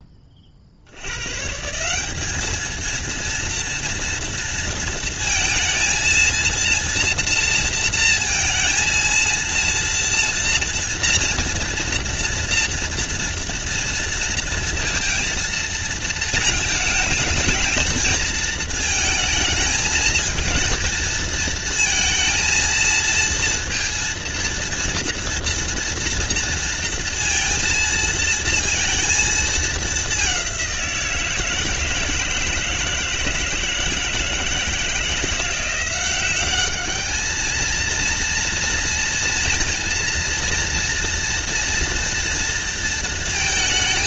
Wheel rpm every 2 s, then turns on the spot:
110, 230, 230, 230, 230, 230, 230, 230, 220, 220, 220, 230, 230, 230, 230, 170, 160, 160, 210, 230, 230, 230.
none